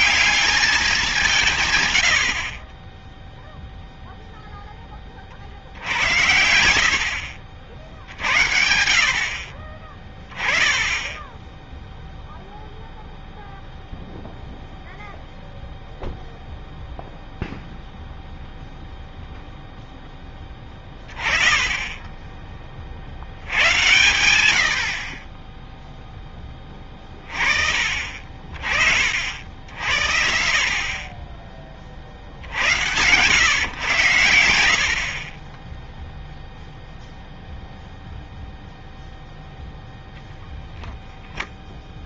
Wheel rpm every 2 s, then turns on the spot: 200, 30, 10, 70, 60, 20, 0, 0, 0, 0, 20, 30, 70, 20, 40, 40, 70, 70, 0, 0, 0.
none